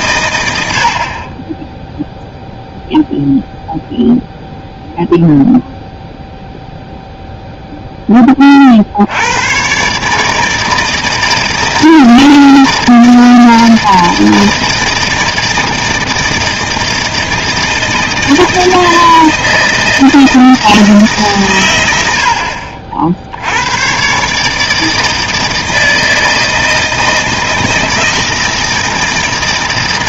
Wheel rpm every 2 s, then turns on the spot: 100, 0, 0, 0, 40, 160, 160, 160, 160, 160, 160, 60, 150, 160, 160.
none